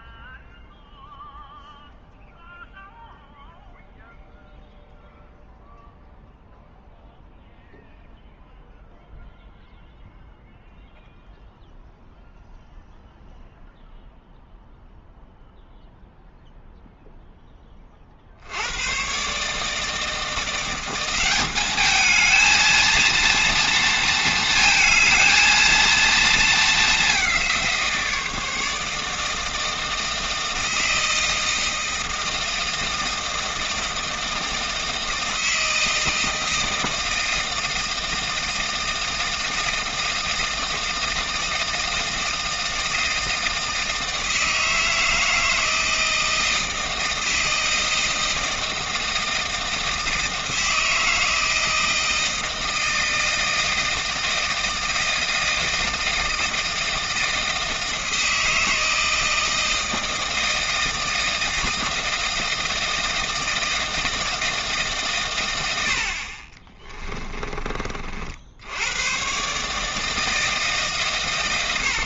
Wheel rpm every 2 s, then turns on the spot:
0, 0, 0, 0, 0, 0, 0, 0, 0, 100, 180, 230, 220, 210, 160, 160, 160, 160, 160, 160, 160, 160, 160, 160, 160, 160, 160, 160, 160, 160, 160, 160, 150, 30, 100, 150.
66-68